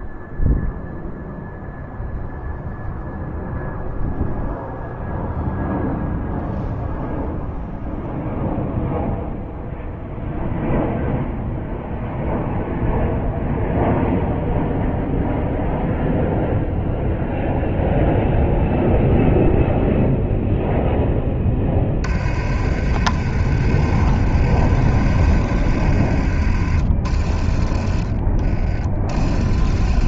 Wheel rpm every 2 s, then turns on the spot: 0, 0, 0, 0, 0, 0, 0, 0, 0, 0, 0, 60, 60, 50, 40.
none